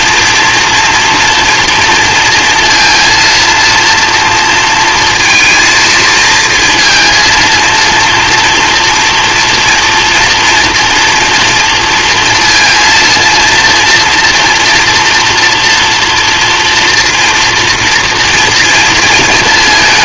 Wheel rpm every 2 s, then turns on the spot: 230, 230, 230, 230, 240, 240, 230, 230, 230, 230.
none